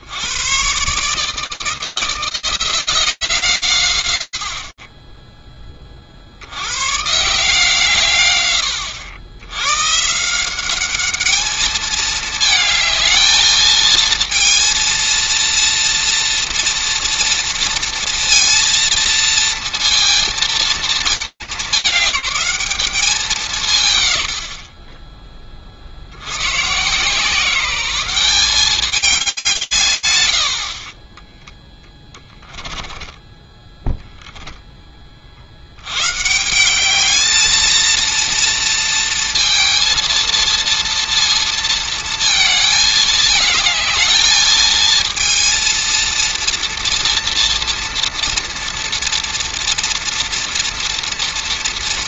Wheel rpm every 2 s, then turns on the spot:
80, 170, 100, 70, 110, 180, 220, 230, 230, 230, 230, 200, 110, 90, 190, 90, 10, 10, 190, 230, 230, 220, 220, 230, 230, 230.
30-34